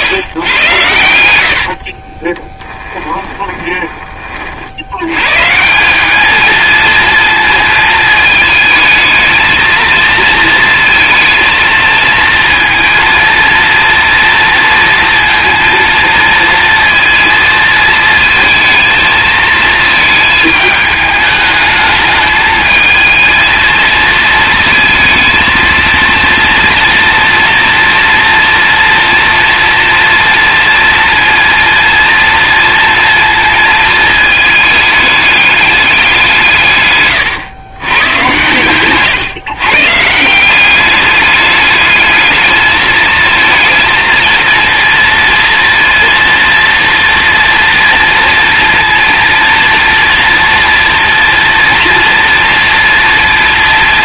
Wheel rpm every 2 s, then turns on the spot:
100, 10, 80, 220, 220, 220, 230, 230, 230, 230, 220, 220, 220, 240, 230, 230, 230, 210, 120, 120, 190, 220, 230, 230, 230, 230, 230.
2-4